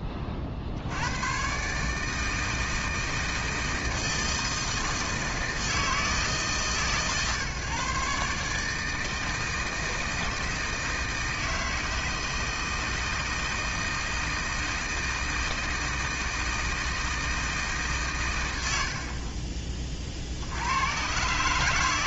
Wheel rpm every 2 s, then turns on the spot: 60, 160, 160, 150, 150, 160, 160, 160, 160, 70, 90.
18-20